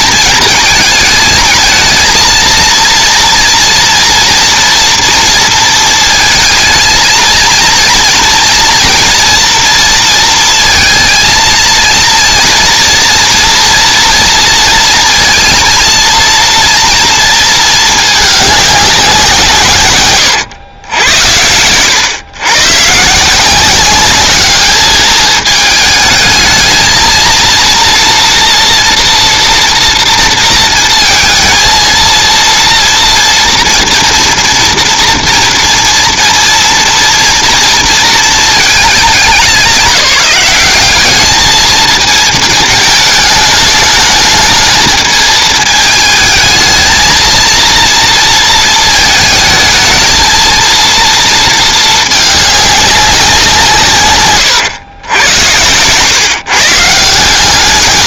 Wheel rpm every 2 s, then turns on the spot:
220, 230, 240, 220, 230, 230, 230, 230, 230, 210, 110, 120, 210, 220, 240, 230, 230, 230, 230, 230, 200, 220, 220, 220, 220, 230, 210, 120, 150.
none